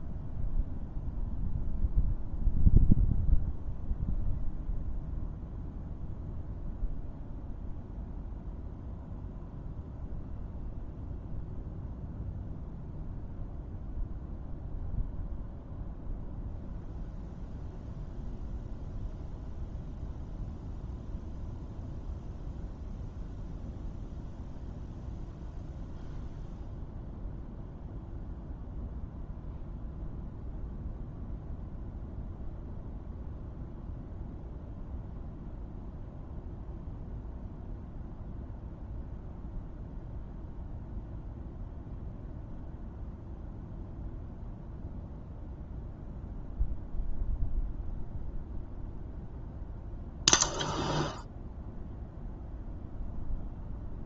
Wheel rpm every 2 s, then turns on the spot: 0, 0, 0, 0, 0, 0, 0, 0, 0, 0, 0, 0, 0, 0, 0, 0, 0, 0, 0, 0, 0, 0, 0, 0, 0, 0, 0.
none